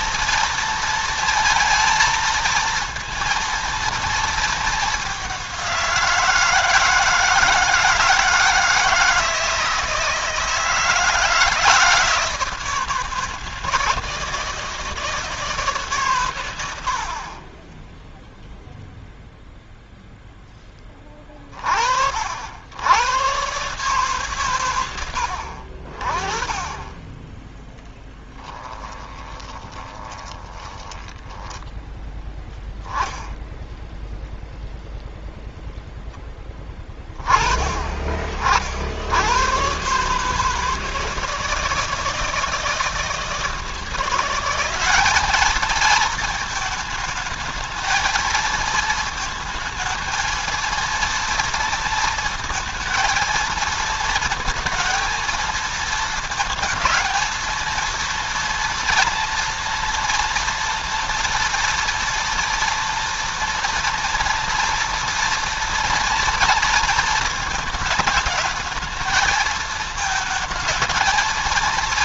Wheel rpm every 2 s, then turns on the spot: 230, 230, 220, 160, 160, 160, 160, 160, 90, 0, 10, 70, 120, 20, 20, 20, 10, 0, 10, 60, 160, 160, 190, 220, 220, 230, 220, 230, 220, 230, 230, 230, 230, 230, 220, 230.
28-32